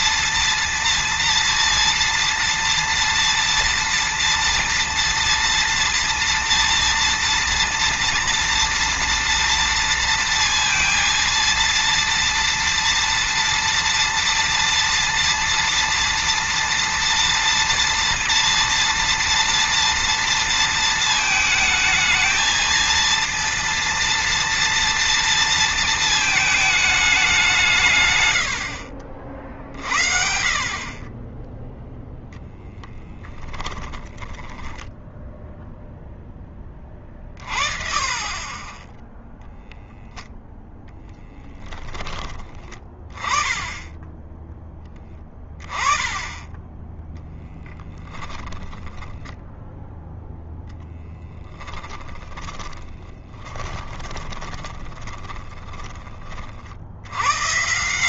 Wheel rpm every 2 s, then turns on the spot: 230, 230, 230, 230, 240, 230, 230, 230, 230, 230, 230, 230, 230, 210, 60, 30, 10, 10, 20, 10, 0, 20, 10, 10, 10, 10, 20, 10, 70.
32-36 50-56